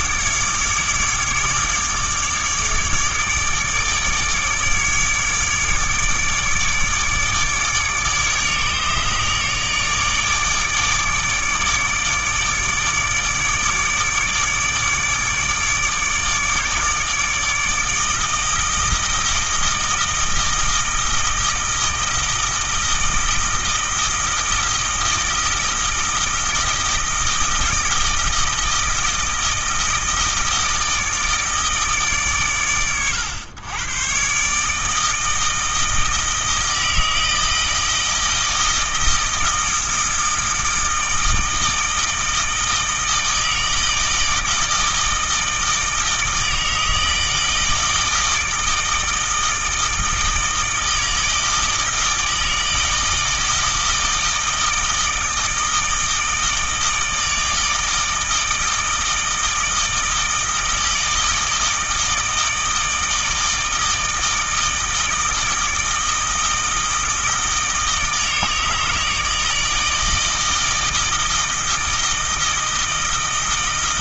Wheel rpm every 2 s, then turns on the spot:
150, 150, 150, 150, 150, 150, 150, 150, 150, 160, 160, 160, 160, 160, 160, 160, 110, 160, 160, 160, 160, 160, 160, 160, 160, 160, 160, 160, 160, 160, 160, 160, 160, 160, 150, 160, 160.
none